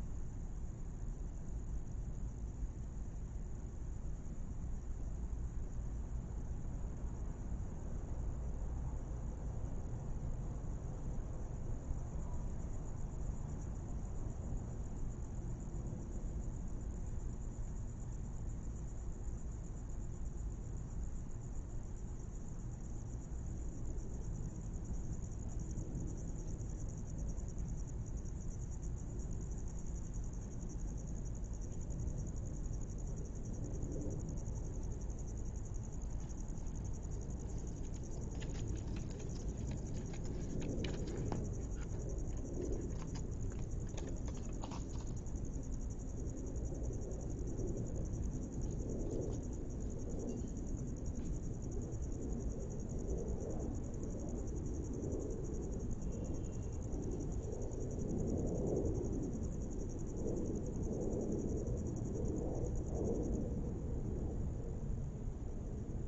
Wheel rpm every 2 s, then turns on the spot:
0, 0, 0, 0, 0, 0, 0, 0, 0, 0, 0, 0, 0, 0, 0, 0, 0, 0, 0, 0, 0, 0, 0, 0, 0, 0, 0, 0, 0, 0, 0, 0, 0.
none